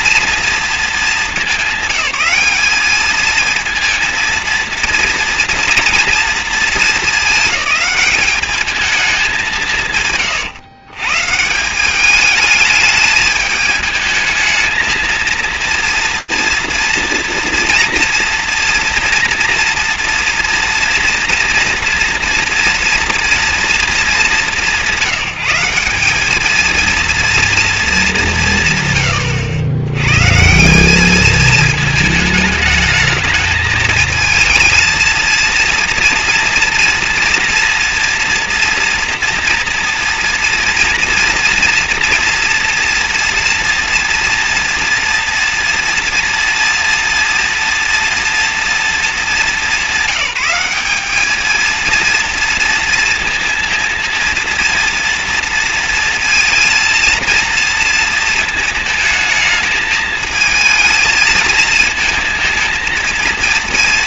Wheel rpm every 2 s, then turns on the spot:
230, 200, 230, 220, 210, 130, 210, 220, 230, 230, 230, 230, 200, 220, 140, 180, 210, 230, 230, 230, 230, 230, 230, 240, 230, 200, 230, 230, 230, 220, 220, 220.
none